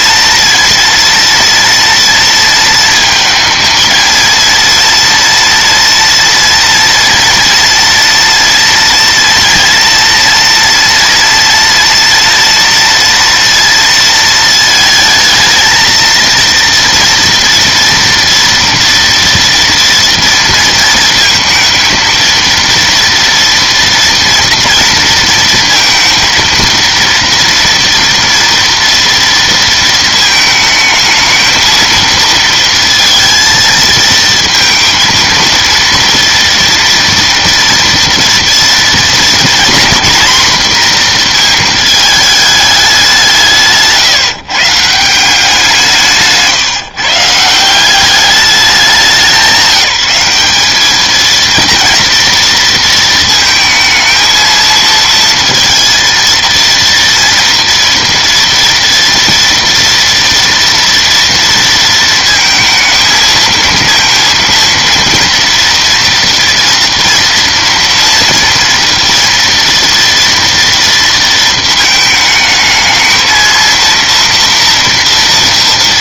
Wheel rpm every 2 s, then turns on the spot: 230, 230, 230, 230, 230, 230, 230, 220, 230, 230, 230, 230, 230, 230, 230, 220, 230, 230, 230, 230, 240, 210, 140, 160, 200, 200, 230, 220, 230, 230, 230, 230, 230, 230, 230, 230, 220, 230.
none